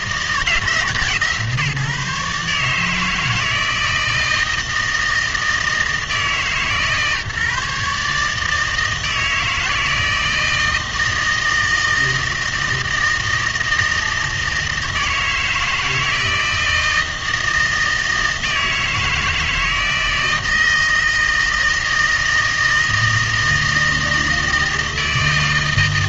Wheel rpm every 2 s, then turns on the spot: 160, 150, 160, 150, 160, 160, 160, 160, 160, 160, 160, 160, 160.
none